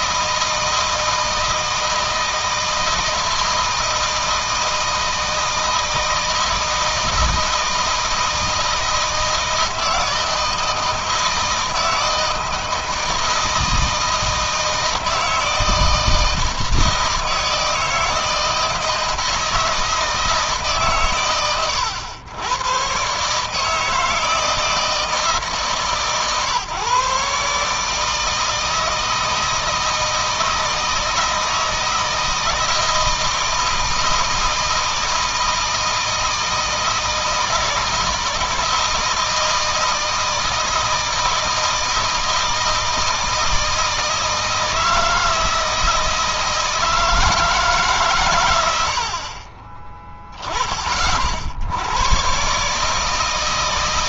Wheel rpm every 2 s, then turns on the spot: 160, 160, 160, 160, 160, 160, 160, 160, 160, 160, 130, 130, 160, 140, 160, 160, 160, 160, 160, 160, 160, 160, 160, 160, 70, 40, 150.
none